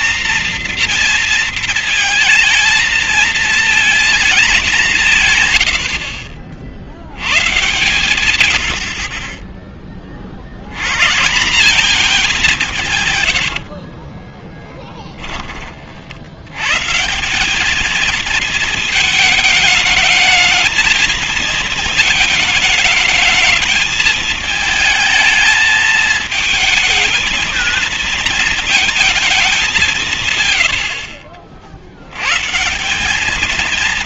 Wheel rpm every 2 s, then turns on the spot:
240, 230, 160, 90, 50, 170, 110, 30, 210, 220, 230, 220, 220, 230, 180, 80, 220.
12-14